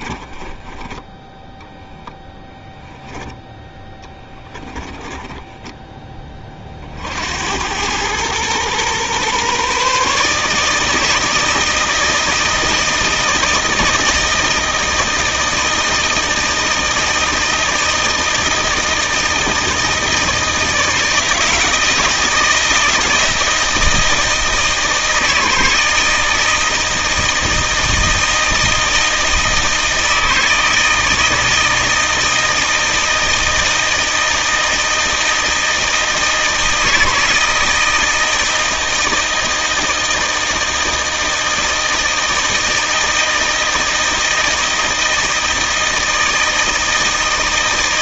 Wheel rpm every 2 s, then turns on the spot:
10, 10, 20, 40, 120, 160, 160, 160, 160, 160, 160, 160, 160, 160, 160, 160, 160, 160, 160, 160, 160, 160, 160, 160.
0-6